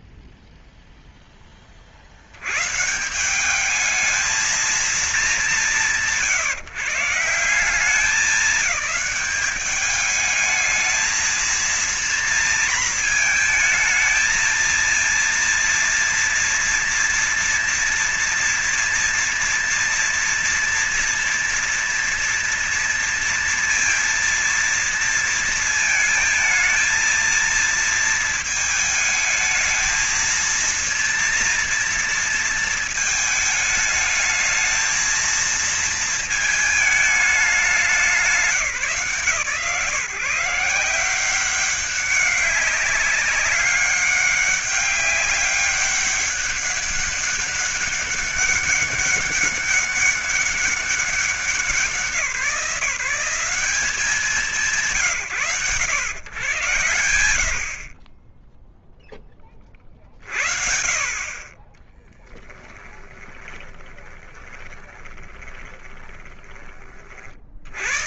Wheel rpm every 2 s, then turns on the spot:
20, 190, 180, 170, 190, 220, 230, 230, 230, 230, 230, 230, 230, 230, 220, 230, 210, 220, 190, 130, 180, 200, 200, 200, 200, 180, 160, 110, 50, 20, 30, 20, 20, 70.
62-66